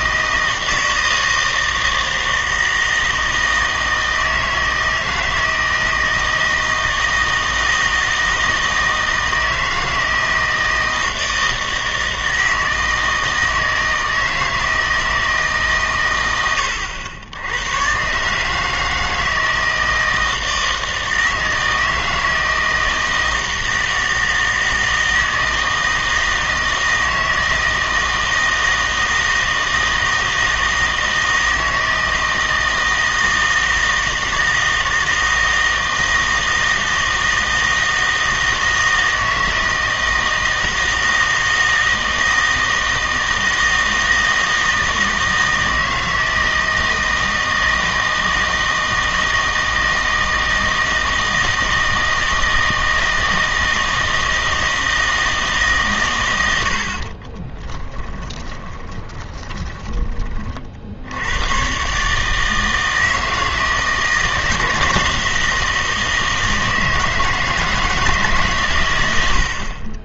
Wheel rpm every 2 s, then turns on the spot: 160, 160, 160, 160, 160, 160, 160, 160, 90, 160, 160, 160, 160, 160, 160, 160, 160, 160, 160, 160, 160, 160, 160, 160, 160, 160, 160, 160, 80, 10, 50, 160, 160, 160, 130.
58-60